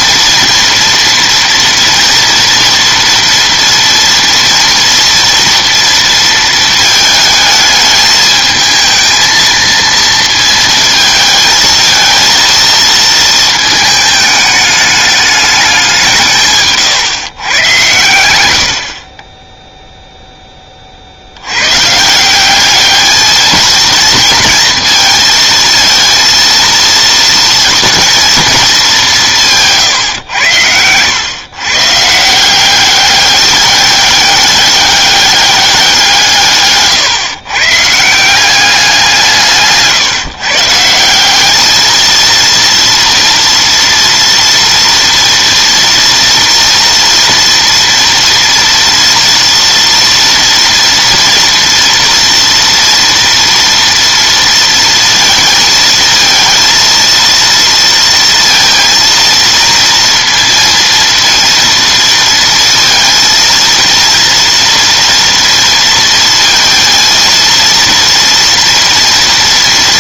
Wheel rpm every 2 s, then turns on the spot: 230, 230, 230, 220, 220, 220, 230, 210, 140, 70, 30, 200, 230, 230, 200, 90, 190, 200, 140, 190, 150, 230, 230, 230, 230, 230, 230, 230, 230, 230, 230, 230, 240, 220, 230.
none